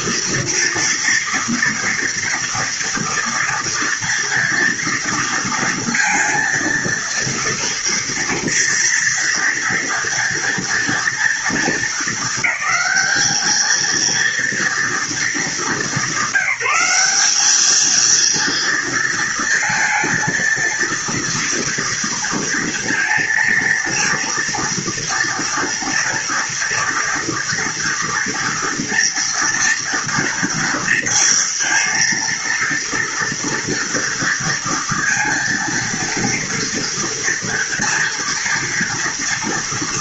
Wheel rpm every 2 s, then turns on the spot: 240, 240, 240, 230, 230, 230, 210, 230, 190, 230, 230, 230, 230, 230, 230, 230, 230, 230, 230, 230.
none